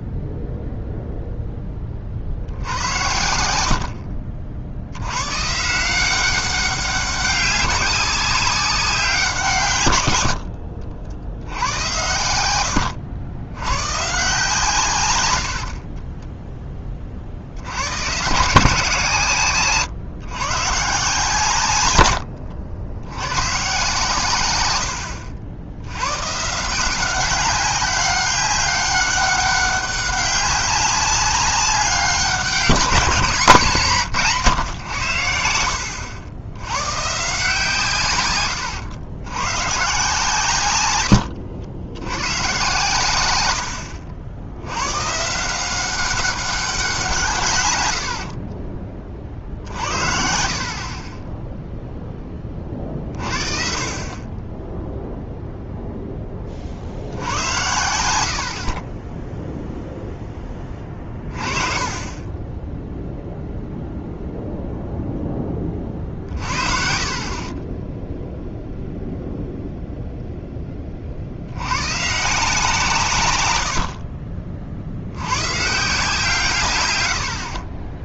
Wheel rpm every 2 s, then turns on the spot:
0, 70, 70, 190, 190, 80, 90, 140, 10, 160, 140, 90, 100, 150, 200, 190, 190, 130, 100, 100, 120, 130, 90, 190, 40, 50, 30, 10, 40, 50, 20, 10, 0, 50, 0, 10, 170, 50, 140.
10-12 22-24 48-50 66-68